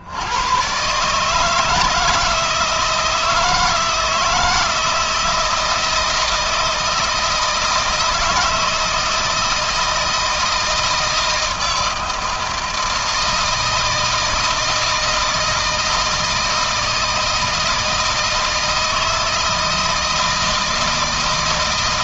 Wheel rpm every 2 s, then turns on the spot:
130, 160, 160, 160, 160, 160, 160, 160, 170, 160, 160.
none